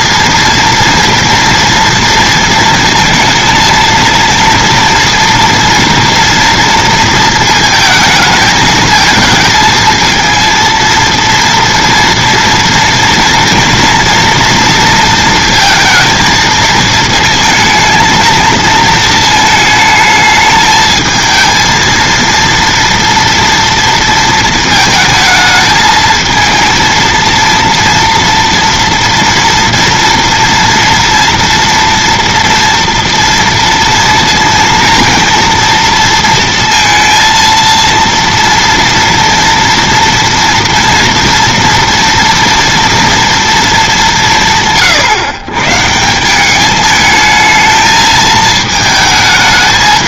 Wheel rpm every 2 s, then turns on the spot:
230, 230, 230, 230, 220, 230, 230, 230, 220, 230, 220, 230, 230, 230, 230, 230, 240, 230, 230, 230, 230, 230, 160, 200, 220.
none